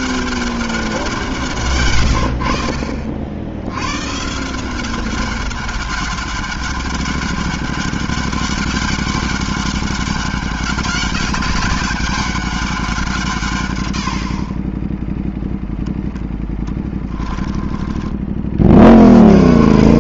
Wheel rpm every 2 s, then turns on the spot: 170, 70, 190, 200, 200, 190, 160, 0, 10, 60.
16-18